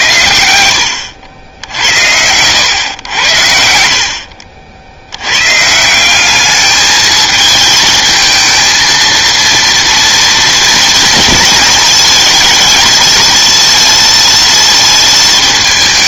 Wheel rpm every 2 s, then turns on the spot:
80, 110, 60, 210, 230, 230, 230, 230.
none